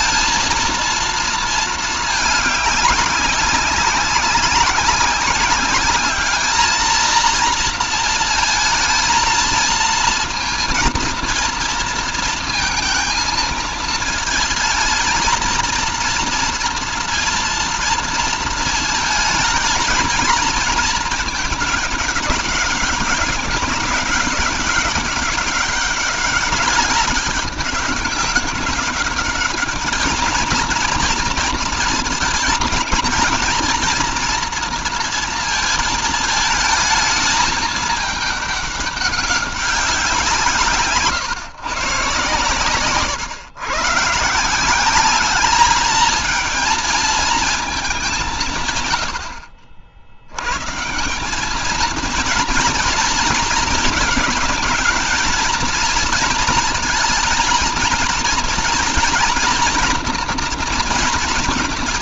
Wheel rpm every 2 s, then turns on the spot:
230, 210, 190, 220, 220, 230, 230, 220, 230, 230, 220, 190, 190, 200, 200, 230, 230, 230, 220, 210, 150, 130, 190, 230, 120, 140, 230, 230, 220, 230, 230.
none